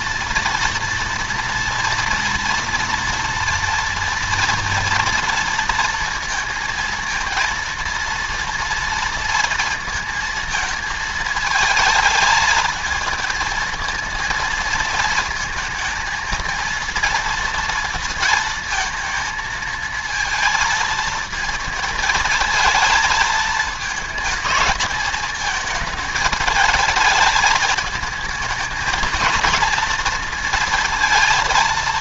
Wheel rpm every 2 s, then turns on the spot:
230, 230, 230, 230, 230, 220, 220, 220, 230, 230, 230, 230, 220, 210, 220, 230.
none